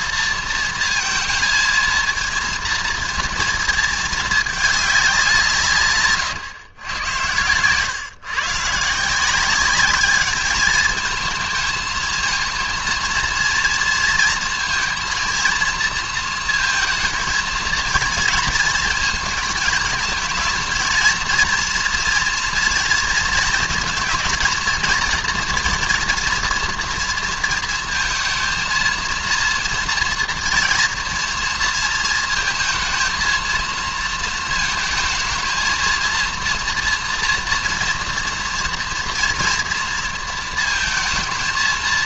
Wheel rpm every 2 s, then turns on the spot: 230, 230, 210, 120, 140, 210, 230, 230, 230, 220, 230, 230, 230, 230, 230, 230, 230, 230, 230, 230, 230.
none